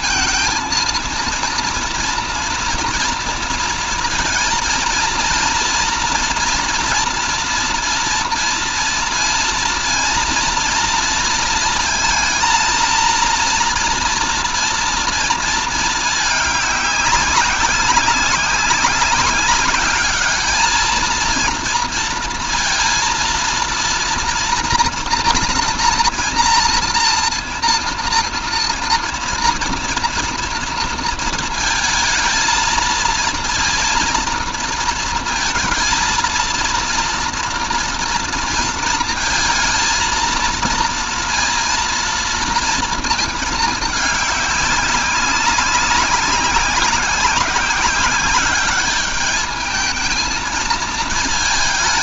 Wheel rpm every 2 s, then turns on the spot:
230, 230, 230, 240, 230, 230, 230, 230, 200, 190, 220, 230, 240, 230, 230, 230, 220, 230, 230, 230, 230, 230, 200, 190, 200, 220.
none